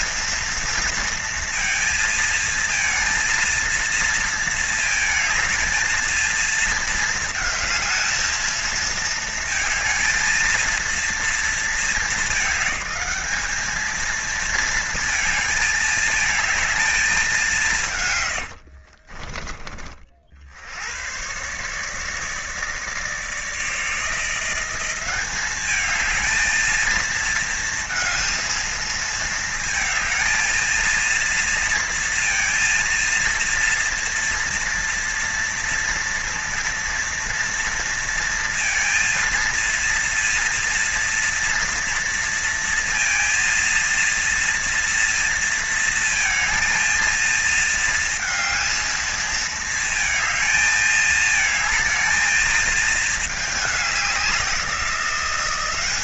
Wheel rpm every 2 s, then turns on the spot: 230, 230, 220, 220, 230, 230, 210, 220, 220, 70, 90, 150, 190, 220, 230, 230, 230, 240, 230, 230, 230, 230, 230, 230, 220, 220, 220, 190.
18-20